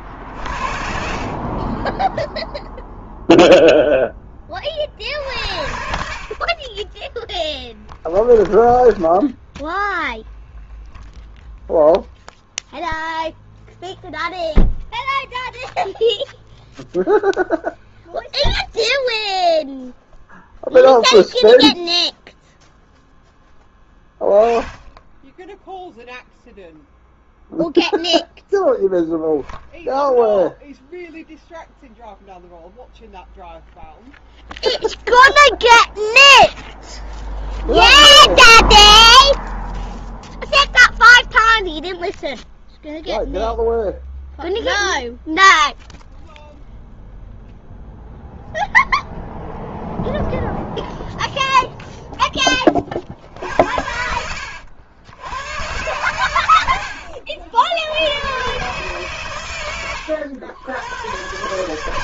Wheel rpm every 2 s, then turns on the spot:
50, 0, 40, 20, 20, 0, 0, 0, 0, 0, 0, 0, 10, 0, 0, 0, 0, 0, 0, 0, 0, 0, 0, 0, 0, 0, 50, 90, 80, 120, 110.
0-2 6-10